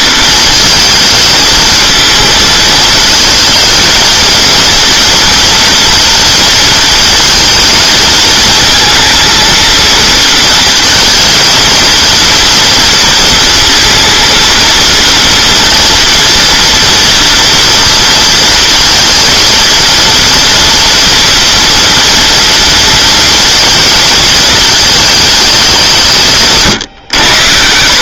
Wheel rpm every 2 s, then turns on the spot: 220, 230, 230, 230, 220, 230, 230, 230, 230, 230, 230, 230, 220, 120.
none